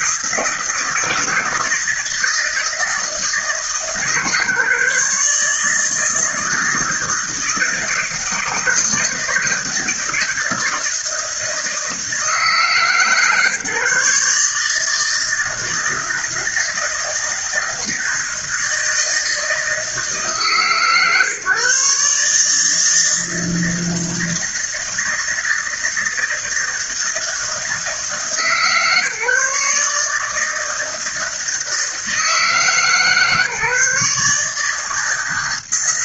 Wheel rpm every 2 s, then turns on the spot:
160, 160, 140, 160, 160, 160, 150, 160, 160, 160, 140, 160, 160, 160, 150, 160, 140, 160.
none